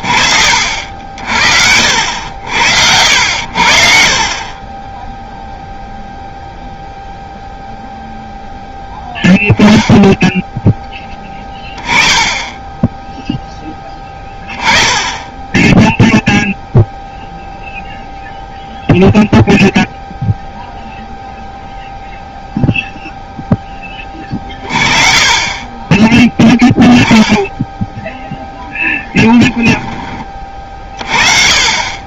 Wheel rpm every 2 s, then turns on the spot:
50, 80, 20, 0, 10, 20, 10, 10, 0, 0, 0, 0, 40, 0, 10, 40.
28-30